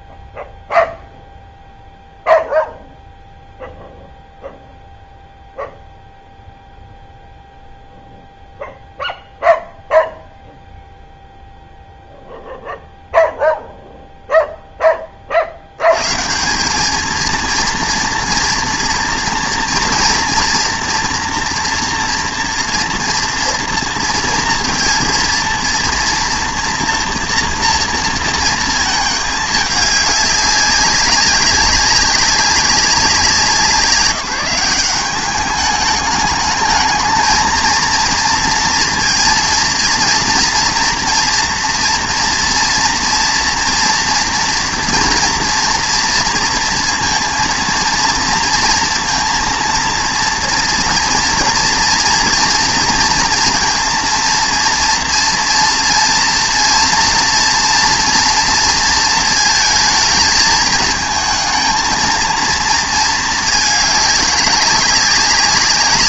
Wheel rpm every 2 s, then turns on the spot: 0, 0, 0, 0, 0, 0, 0, 10, 190, 230, 230, 230, 230, 230, 230, 200, 190, 180, 210, 230, 230, 230, 240, 230, 230, 240, 230, 230, 230, 230, 220, 230, 200.
none